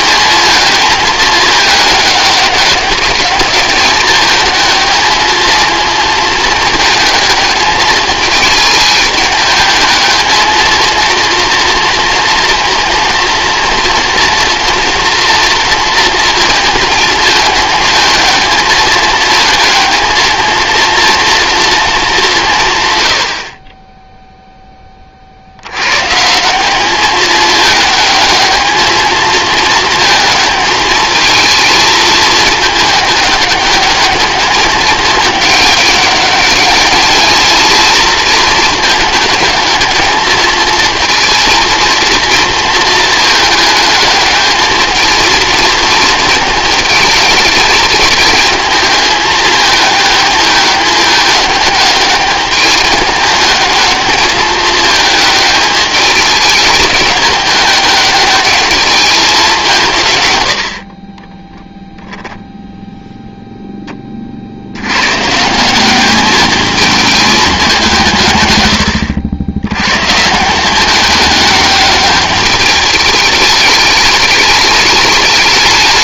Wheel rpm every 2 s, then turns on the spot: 210, 200, 220, 220, 210, 220, 230, 230, 220, 220, 230, 150, 10, 200, 220, 220, 220, 210, 210, 220, 220, 230, 220, 220, 220, 210, 210, 210, 210, 210, 80, 0, 80, 220, 110, 180, 210, 210.
none